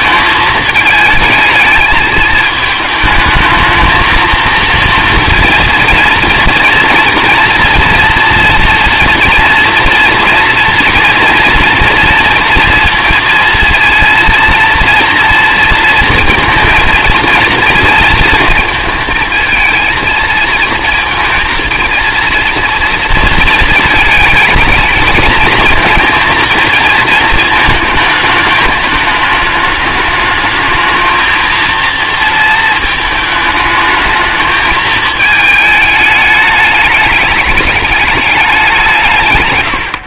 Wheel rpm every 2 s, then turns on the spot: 220, 220, 230, 230, 240, 240, 230, 230, 230, 220, 230, 230, 220, 230, 210, 220, 220, 220, 210, 180.
none